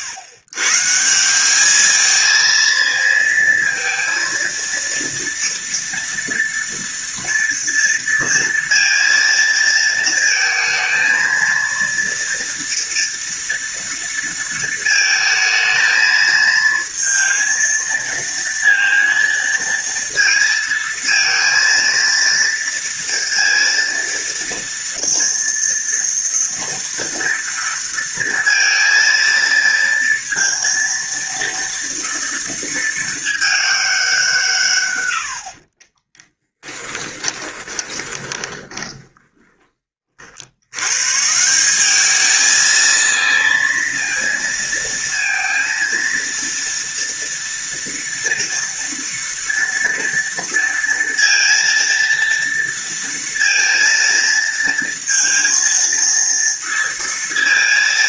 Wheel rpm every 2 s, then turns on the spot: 140, 220, 230, 230, 230, 220, 230, 230, 220, 230, 230, 230, 230, 230, 230, 230, 230, 150, 10, 10, 80, 220, 230, 230, 230, 230, 230, 230, 230.
36-40